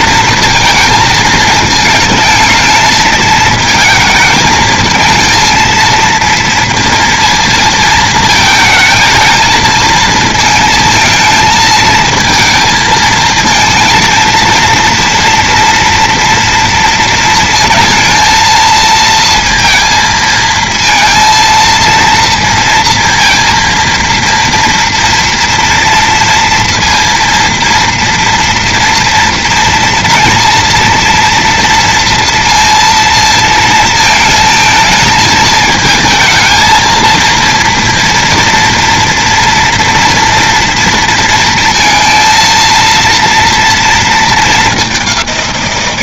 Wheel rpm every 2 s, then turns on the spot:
230, 220, 220, 230, 220, 220, 220, 230, 230, 230, 230, 230, 230, 230, 230, 230, 230, 220, 230, 230, 230, 230, 210.
none